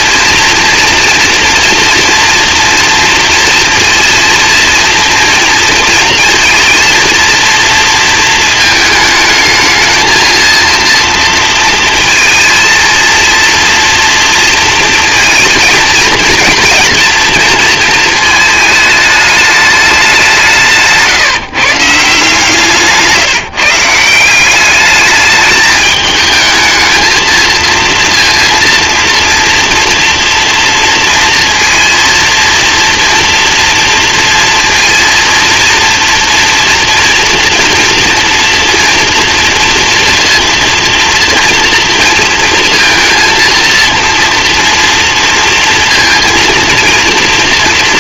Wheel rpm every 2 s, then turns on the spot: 230, 240, 230, 230, 220, 230, 220, 230, 230, 220, 180, 160, 190, 220, 230, 230, 230, 230, 240, 230, 230, 230, 230, 230.
none